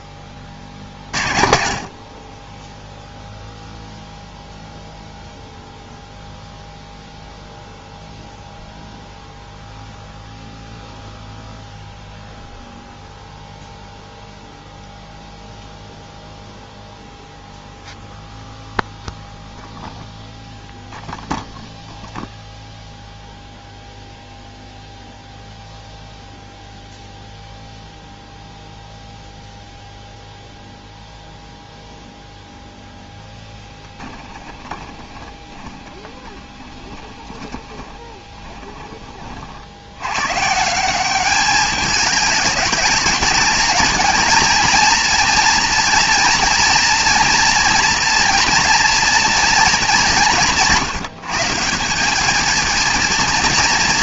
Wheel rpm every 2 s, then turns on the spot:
50, 0, 0, 0, 0, 0, 0, 0, 0, 0, 0, 0, 0, 0, 0, 0, 0, 20, 20, 20, 150, 210, 230, 230, 230, 170, 220.
34-40